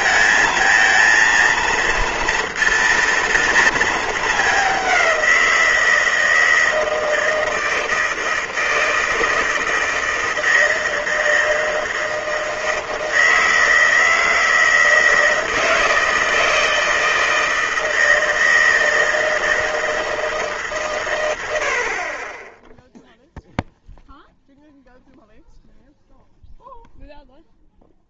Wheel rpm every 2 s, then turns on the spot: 230, 230, 200, 160, 160, 160, 160, 160, 160, 160, 150, 10, 0, 0.
none